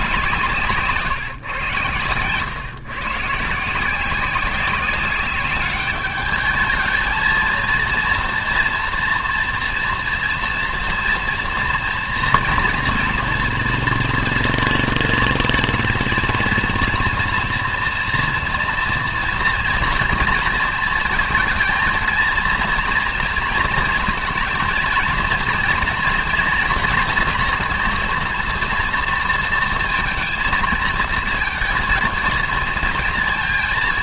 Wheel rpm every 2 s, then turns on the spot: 150, 130, 190, 210, 230, 230, 230, 230, 240, 230, 220, 230, 230, 240, 230, 230, 230.
none